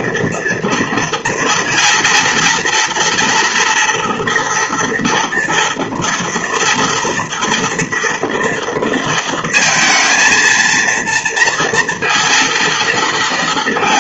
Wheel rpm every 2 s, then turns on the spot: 230, 230, 240, 230, 230, 230, 230.
none